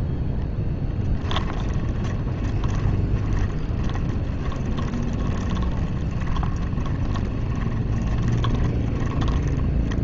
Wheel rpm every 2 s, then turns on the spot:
0, 20, 20, 20, 20.
2-10